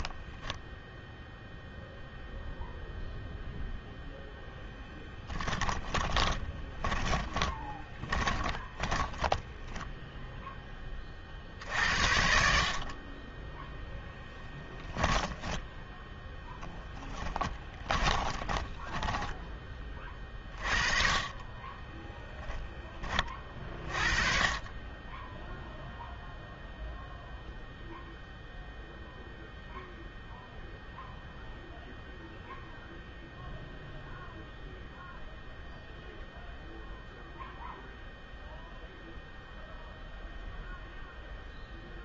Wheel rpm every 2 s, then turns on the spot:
10, 0, 10, 20, 20, 20, 50, 10, 10, 20, 40, 10, 30, 0, 0, 0, 0, 0, 0, 0, 0.
4-10 14-20